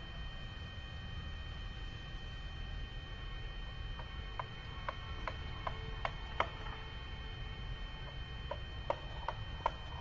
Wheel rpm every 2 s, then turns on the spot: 0, 0, 0, 0, 0.
none